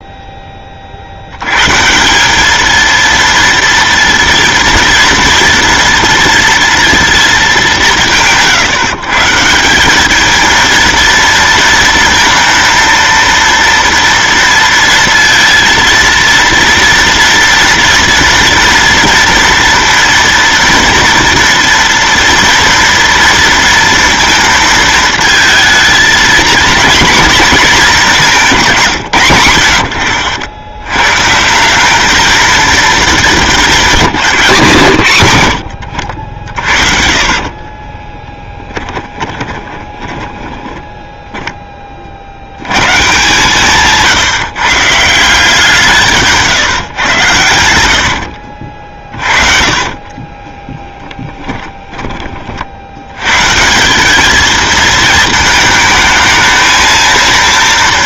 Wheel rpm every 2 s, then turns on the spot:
20, 220, 230, 230, 150, 220, 230, 230, 230, 230, 230, 230, 230, 240, 190, 80, 220, 170, 70, 10, 10, 90, 150, 150, 50, 20, 30, 210, 220.
36-42 48-52